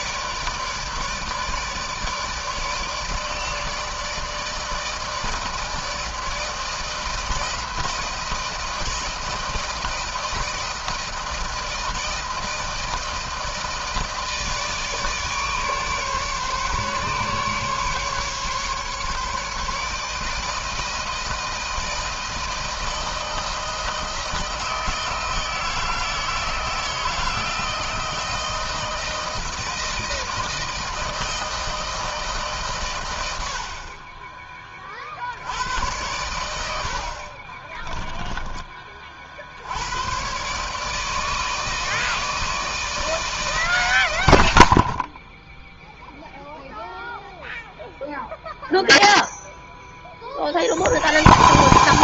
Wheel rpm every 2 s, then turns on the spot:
150, 150, 160, 160, 160, 160, 160, 160, 140, 140, 160, 160, 160, 160, 170, 160, 140, 20, 90, 10, 110, 160, 100, 0, 0, 50.
none